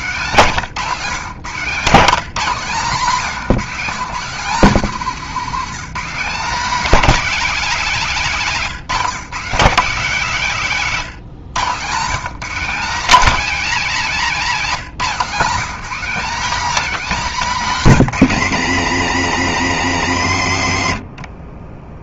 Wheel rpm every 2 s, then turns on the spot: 160, 170, 200, 250, 180, 160, 230, 210, 250, 140, 60.
none